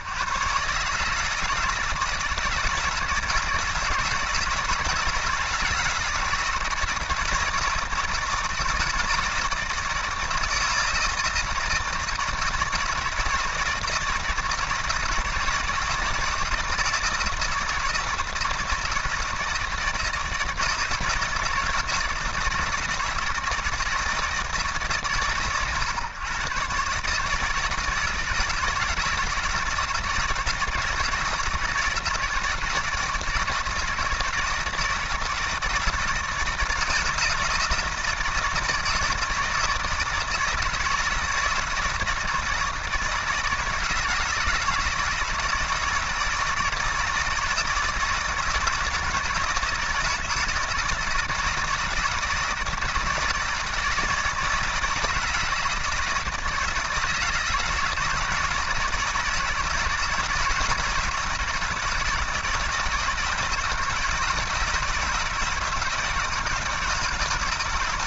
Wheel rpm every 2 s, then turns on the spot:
140, 160, 160, 160, 160, 160, 160, 160, 160, 160, 160, 160, 140, 130, 160, 160, 160, 160, 170, 160, 160, 160, 160, 160, 160, 160, 160, 160, 160, 170, 160, 160, 160, 160.
none